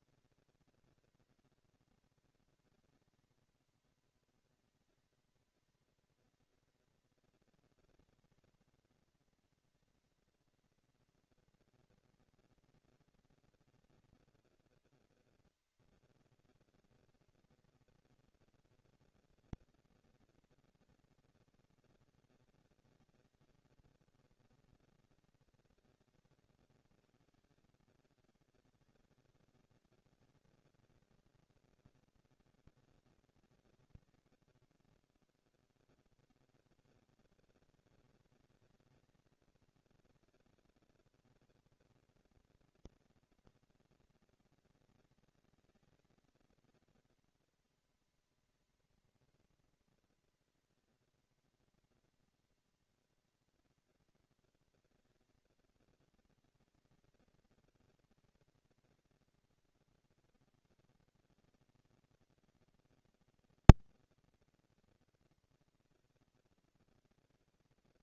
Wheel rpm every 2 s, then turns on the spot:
230, 230, 230, 230, 230, 230, 230, 240, 240, 230, 230, 210, 200, 120, 150, 220, 220, 90, 110, 220, 230, 230, 230, 220, 230, 230, 230, 230, 230, 230, 230, 230, 230, 230.
34-36